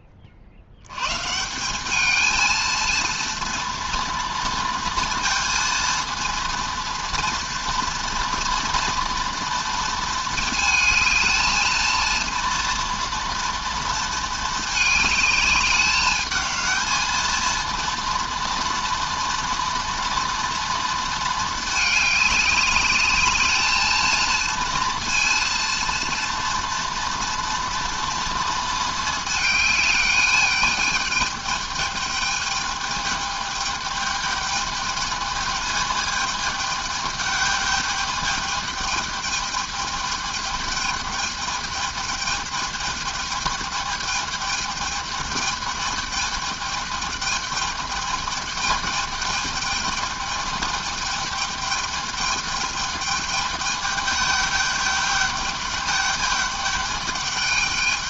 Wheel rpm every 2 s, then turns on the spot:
50, 230, 230, 240, 240, 220, 230, 220, 210, 230, 230, 210, 230, 230, 220, 210, 220, 210, 210, 210, 210, 210, 210, 210, 210, 210, 210, 210, 210.
none